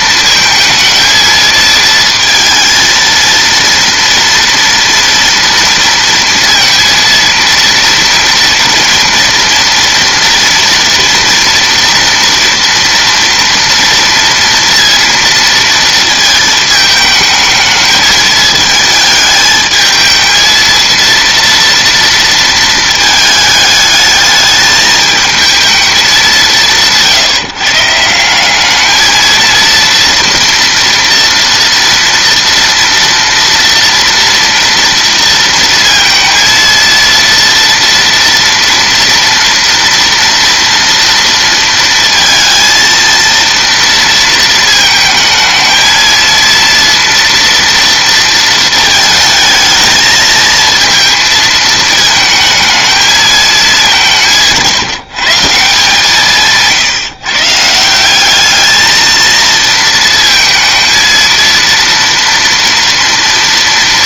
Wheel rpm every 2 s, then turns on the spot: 220, 230, 230, 230, 240, 230, 230, 230, 220, 220, 230, 220, 220, 160, 210, 240, 230, 230, 230, 230, 230, 230, 220, 230, 220, 230, 220, 160, 150, 220, 230, 230.
none